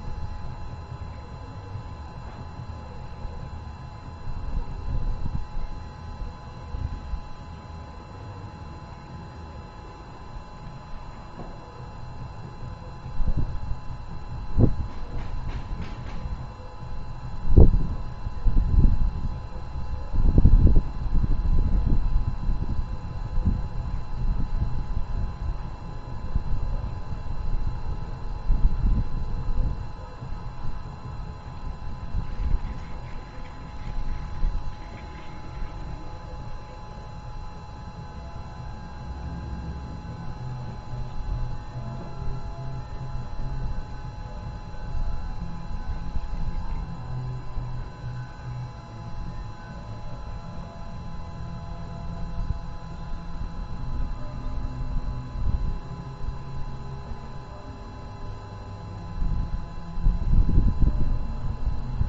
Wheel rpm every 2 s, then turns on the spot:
0, 0, 0, 0, 0, 0, 0, 0, 0, 0, 0, 0, 0, 0, 0, 0, 0, 0, 0, 0, 0, 0, 0, 0, 0, 0, 0, 0, 0, 0, 0.
none